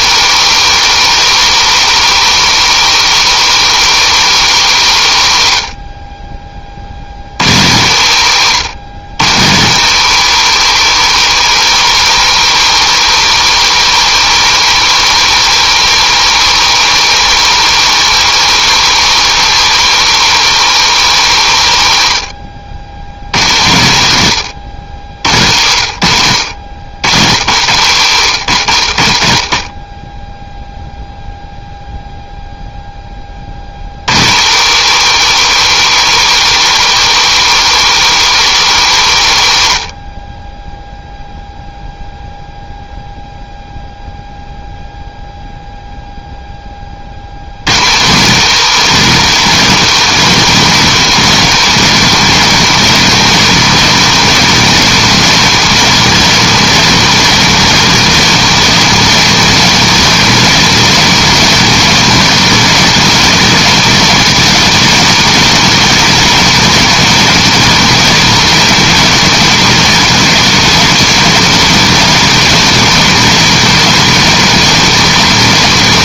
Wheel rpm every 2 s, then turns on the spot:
170, 170, 130, 50, 130, 170, 170, 170, 170, 170, 160, 90, 90, 90, 70, 0, 10, 150, 170, 150, 10, 0, 0, 30, 210, 210, 220, 220, 220, 230, 230, 230, 220, 230, 230, 230, 230, 230.
none